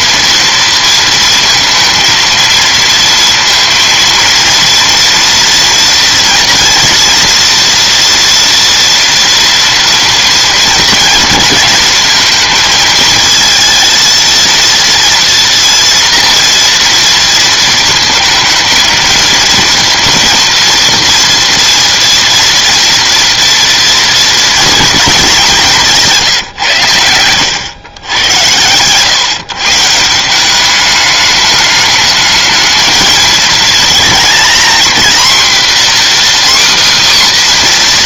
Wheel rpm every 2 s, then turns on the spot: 230, 230, 230, 230, 230, 230, 220, 230, 230, 220, 230, 230, 220, 100, 130, 210, 220, 240, 270.
26-28